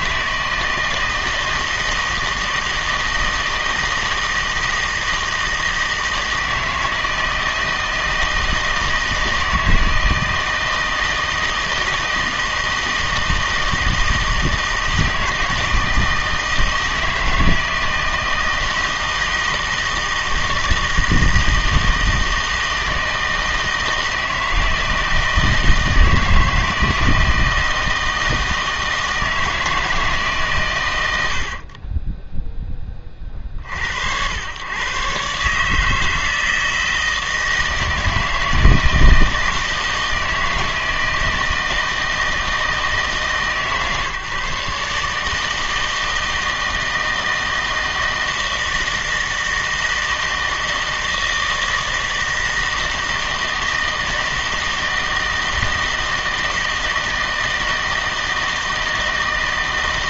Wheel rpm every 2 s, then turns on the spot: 160, 160, 160, 160, 160, 160, 160, 160, 160, 160, 160, 160, 160, 160, 160, 120, 10, 100, 160, 160, 160, 160, 150, 160, 160, 160, 160, 160, 160, 160.
none